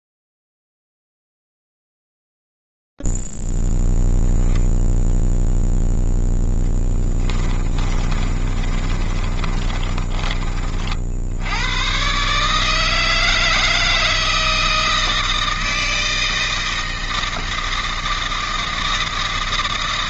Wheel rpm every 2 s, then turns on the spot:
0, 0, 0, 0, 30, 30, 110, 160, 160, 160.
8-12